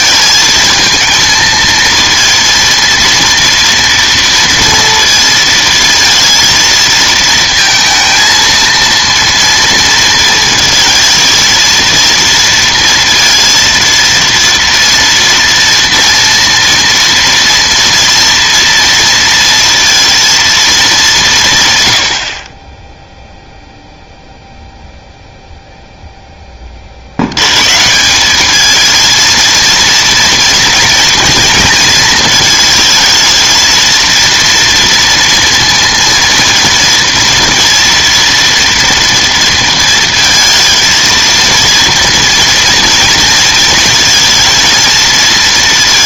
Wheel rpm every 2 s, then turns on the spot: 220, 230, 230, 230, 230, 230, 230, 230, 230, 230, 220, 20, 0, 20, 210, 230, 220, 230, 230, 230, 230, 230, 230.
none